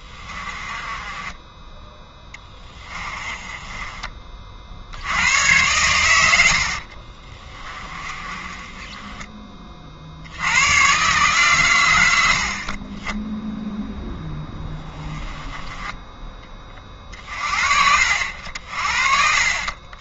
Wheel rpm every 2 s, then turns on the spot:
20, 20, 70, 50, 20, 120, 20, 10, 40, 50.
0-4 6-10